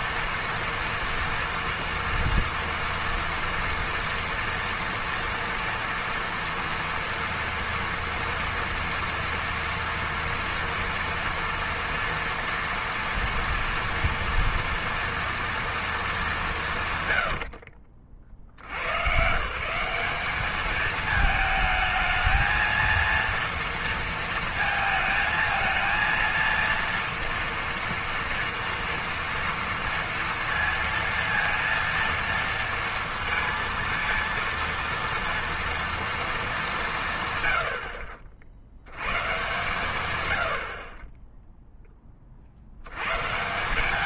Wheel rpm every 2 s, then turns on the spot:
230, 230, 230, 230, 230, 230, 230, 230, 140, 100, 210, 230, 220, 230, 230, 230, 230, 230, 180, 80, 50, 80.
none